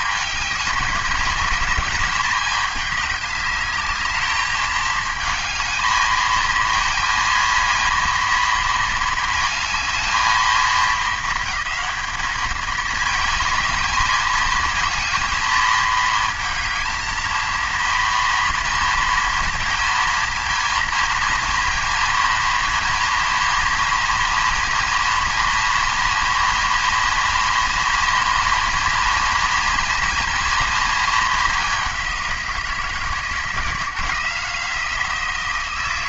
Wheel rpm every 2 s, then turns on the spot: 200, 210, 220, 230, 220, 220, 220, 220, 220, 230, 230, 230, 230, 230, 230, 230, 170, 170.
none